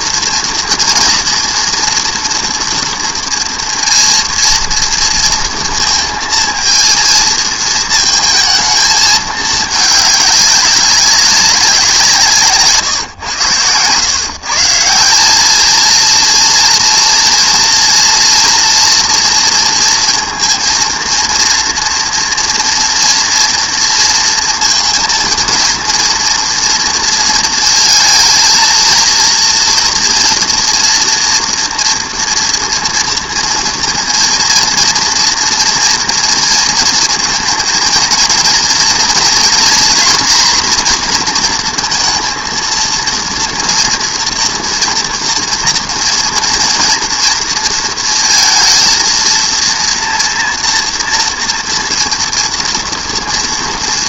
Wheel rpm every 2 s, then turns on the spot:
230, 230, 230, 230, 220, 200, 140, 150, 230, 240, 230, 230, 230, 230, 230, 240, 230, 230, 230, 230, 240, 230, 230, 240, 230, 240, 230.
none